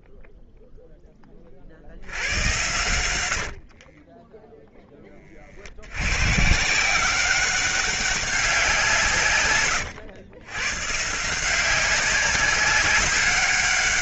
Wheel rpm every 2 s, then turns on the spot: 0, 100, 10, 150, 190, 120, 190.
none